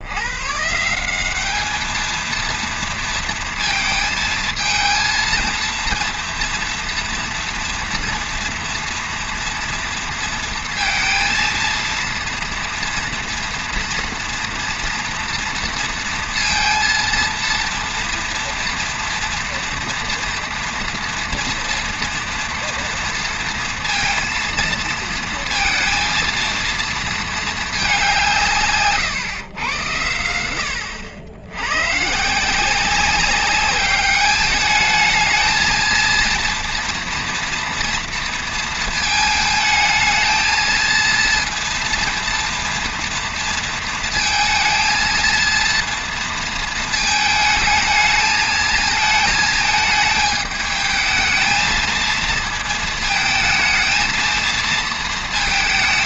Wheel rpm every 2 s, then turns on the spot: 190, 230, 230, 230, 230, 230, 230, 230, 230, 230, 230, 230, 230, 230, 140, 80, 190, 220, 240, 220, 230, 230, 230, 220, 220, 220, 220, 230.
none